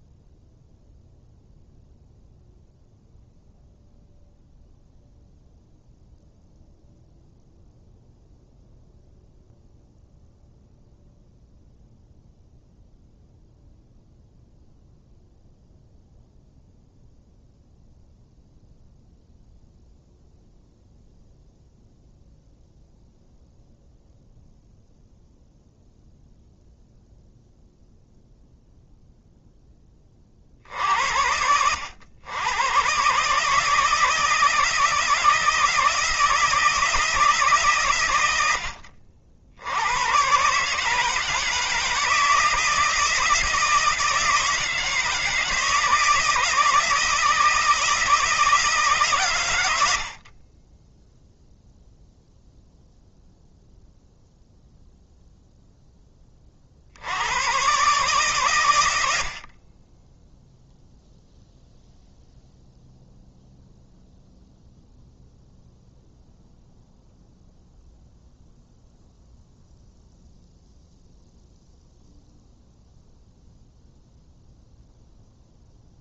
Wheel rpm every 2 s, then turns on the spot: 0, 0, 0, 0, 0, 0, 0, 0, 0, 0, 0, 0, 0, 0, 0, 70, 120, 160, 160, 70, 150, 160, 160, 160, 150, 10, 0, 0, 60, 80, 0, 0, 0, 0, 0, 0, 0, 0.
none